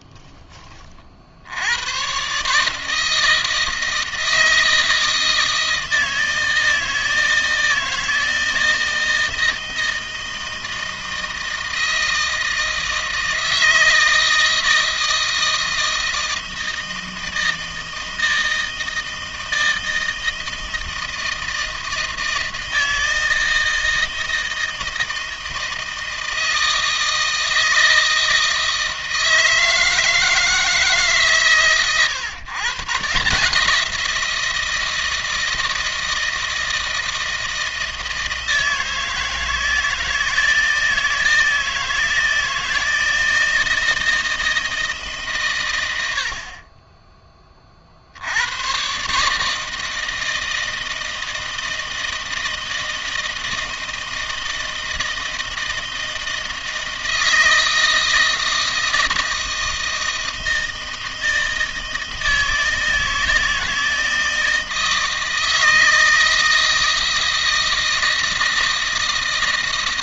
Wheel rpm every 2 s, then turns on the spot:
30, 150, 160, 160, 160, 160, 160, 160, 160, 160, 160, 160, 160, 160, 160, 160, 130, 170, 160, 160, 160, 160, 160, 30, 110, 160, 160, 160, 160, 160, 160, 160, 160, 160, 160.
none